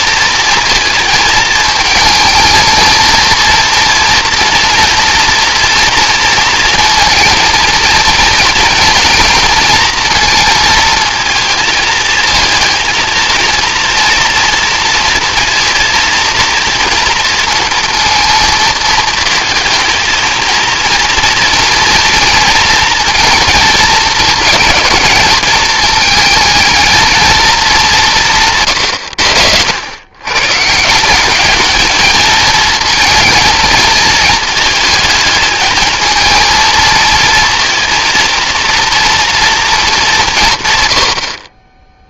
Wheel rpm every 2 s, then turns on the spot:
230, 220, 240, 230, 230, 230, 230, 230, 230, 230, 230, 230, 220, 220, 160, 130, 220, 220, 230, 230, 190.
none